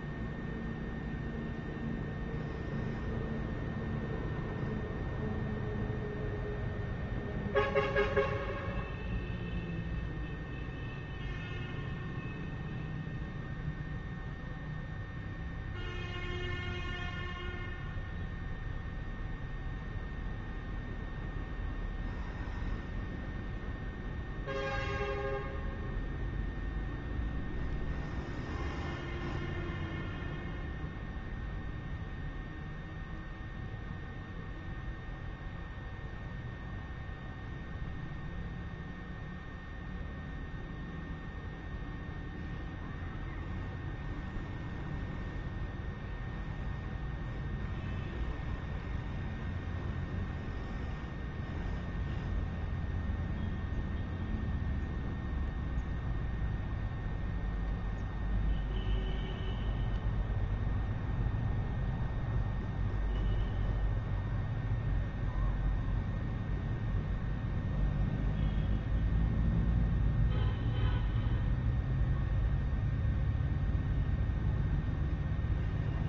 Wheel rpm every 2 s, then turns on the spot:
0, 0, 0, 0, 0, 0, 0, 0, 0, 0, 0, 0, 0, 0, 0, 0, 0, 0, 0, 0, 0, 0, 0, 0, 0, 0, 0, 0, 0, 0, 0, 0, 0, 0, 0, 0, 0, 0.
none